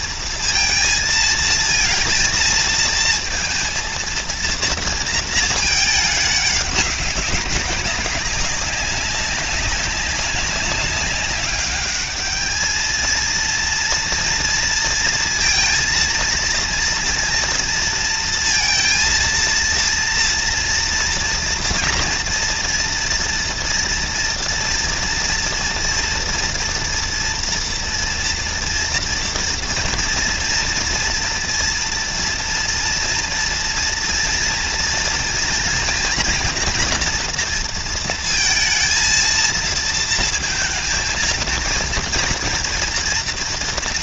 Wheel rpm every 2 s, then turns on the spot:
230, 220, 230, 200, 200, 200, 220, 230, 230, 230, 240, 230, 230, 230, 230, 230, 230, 230, 240, 230, 230, 230.
none